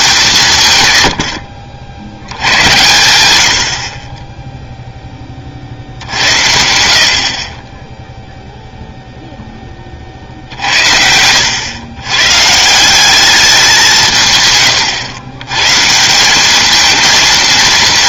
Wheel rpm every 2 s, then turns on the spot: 140, 100, 0, 70, 0, 60, 160, 120, 210.
none